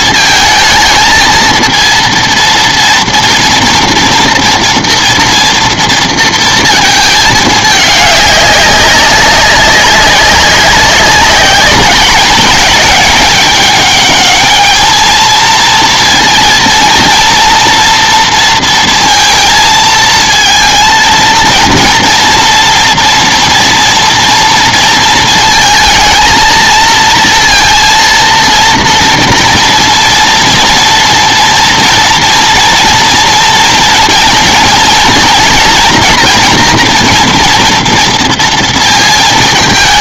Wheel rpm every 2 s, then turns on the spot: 220, 230, 240, 230, 200, 190, 210, 220, 230, 230, 230, 230, 230, 230, 230, 230, 240, 230, 240, 230.
none